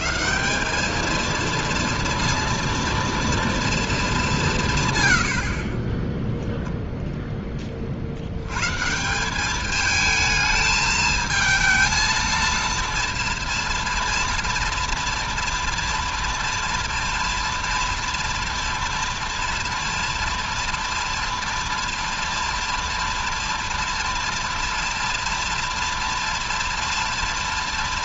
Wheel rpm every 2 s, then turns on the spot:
170, 230, 160, 0, 110, 220, 230, 230, 230, 230, 230, 230, 230, 230.
none